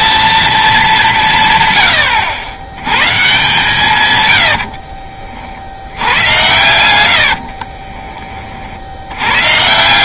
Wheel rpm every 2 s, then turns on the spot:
210, 90, 80, 100, 50.
4-8